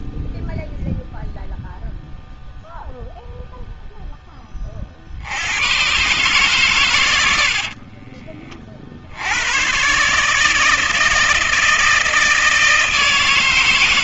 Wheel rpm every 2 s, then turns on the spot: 0, 0, 0, 70, 80, 90, 160.
8-10